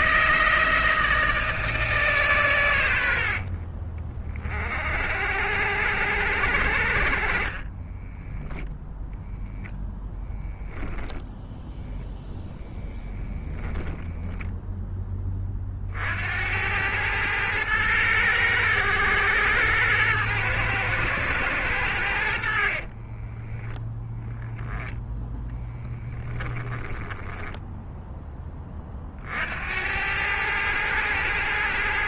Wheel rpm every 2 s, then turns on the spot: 160, 110, 50, 70, 0, 10, 10, 10, 90, 100, 110, 40, 10, 10, 30, 110.
2-4 10-12 22-24 26-28